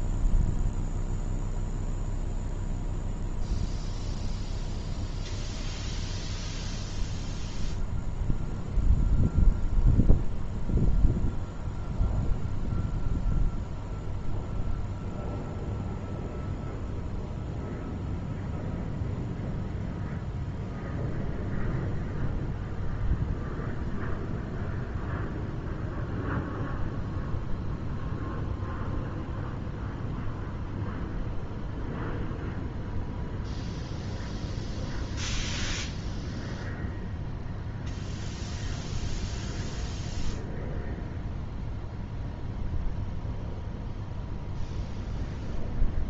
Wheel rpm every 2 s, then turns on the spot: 0, 0, 0, 0, 0, 0, 0, 0, 0, 0, 0, 0, 0, 0, 0, 0, 0, 0, 0, 0, 0, 0, 0.
none